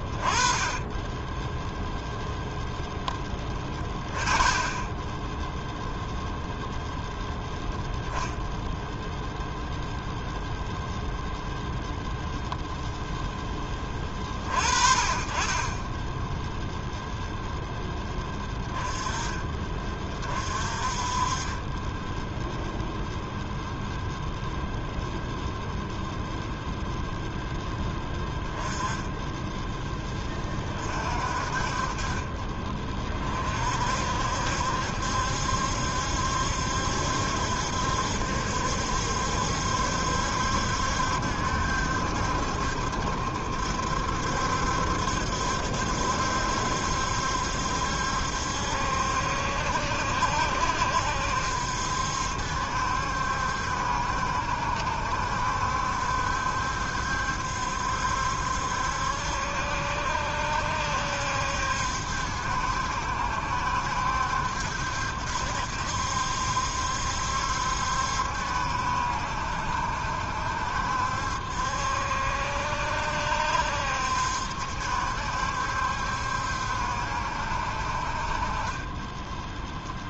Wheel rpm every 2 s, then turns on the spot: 10, 0, 20, 0, 0, 0, 0, 40, 0, 10, 40, 0, 0, 0, 10, 30, 30, 60, 70, 70, 70, 70, 70, 70, 70, 70, 70, 70, 70, 70, 70, 70, 70, 70, 70, 70, 70, 70, 70, 30.
0-2 4-6